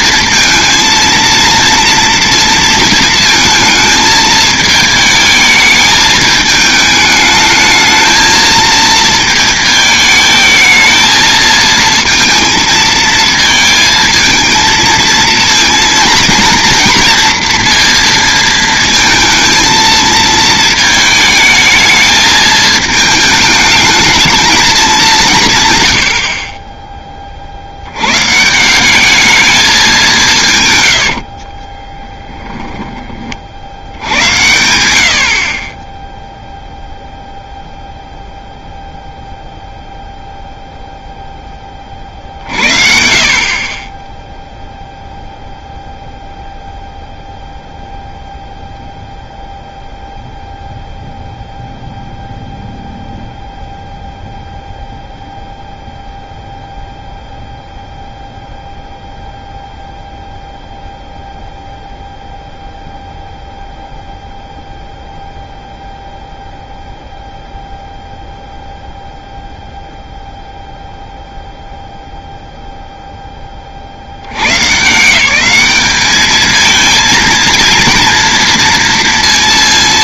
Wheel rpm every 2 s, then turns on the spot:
230, 230, 220, 220, 220, 220, 230, 220, 230, 230, 220, 220, 210, 20, 180, 110, 10, 90, 0, 0, 0, 60, 0, 0, 0, 0, 0, 0, 0, 0, 0, 0, 0, 0, 0, 0, 0, 150, 220, 230.
none